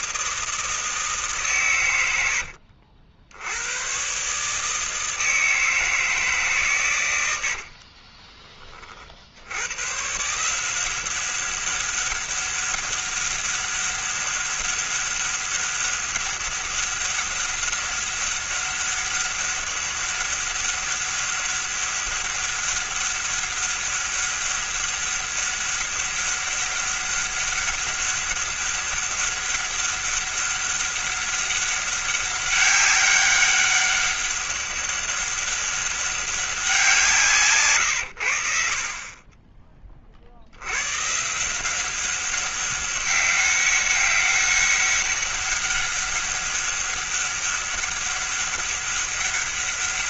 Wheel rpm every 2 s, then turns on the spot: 160, 80, 160, 110, 40, 180, 200, 200, 200, 200, 200, 200, 200, 200, 200, 200, 200, 200, 180, 50, 120, 200, 200, 200, 200.
none